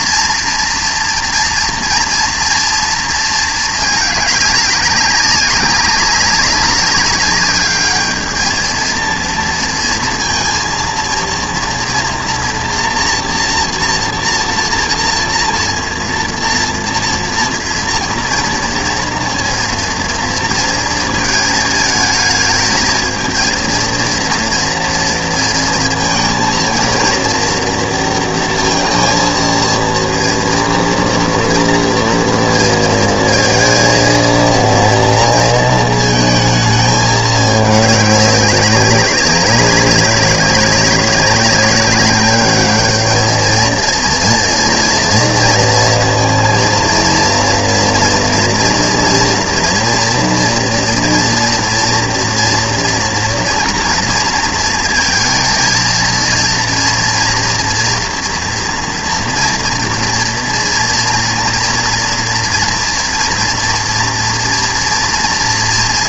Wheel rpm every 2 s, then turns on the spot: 230, 240, 200, 190, 220, 230, 230, 230, 230, 230, 230, 220, 230, 230, 230, 230, 230, 230, 220, 200, 200, 210, 230, 230, 240, 230, 230, 230, 230, 240, 230, 230, 230.
none